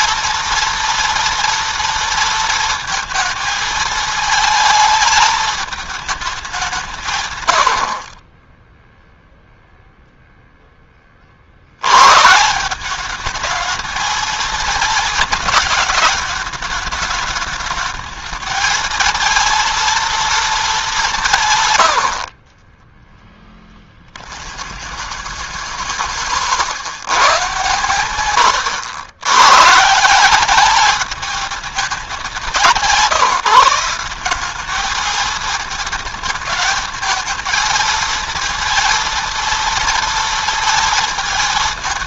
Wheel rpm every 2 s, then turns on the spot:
230, 230, 220, 160, 0, 20, 200, 220, 220, 230, 200, 20, 80, 110, 100, 210, 180, 220, 220, 230, 220.
22-24